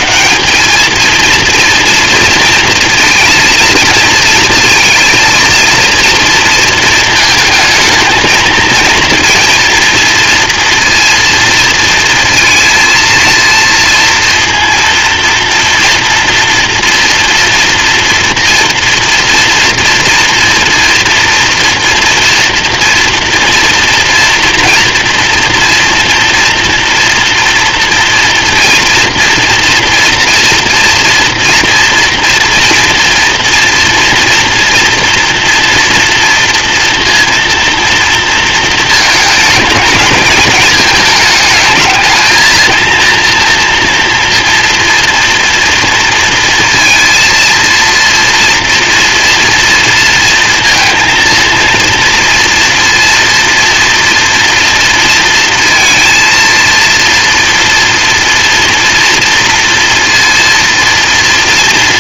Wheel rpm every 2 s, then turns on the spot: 230, 230, 230, 230, 230, 230, 230, 230, 240, 230, 230, 240, 230, 230, 240, 240, 230, 230, 240, 220, 220, 230, 230, 230, 230, 230, 230, 230, 230, 230, 230.
none